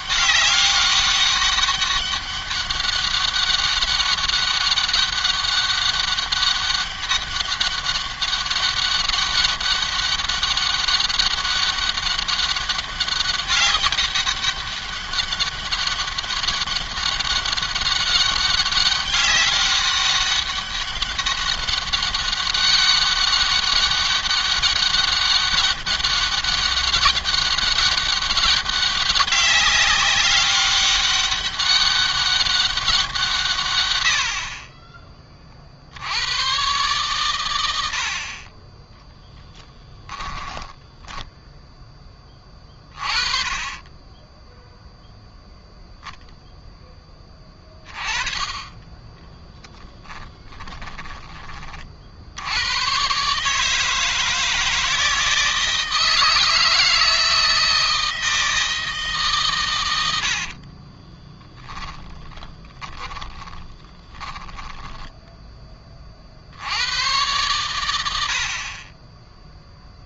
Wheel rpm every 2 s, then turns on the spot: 200, 200, 200, 200, 200, 200, 200, 200, 200, 200, 200, 200, 200, 200, 190, 200, 180, 30, 120, 20, 10, 20, 0, 10, 20, 20, 120, 160, 160, 160, 40, 10, 10, 100, 30.
38-42 50-52 60-66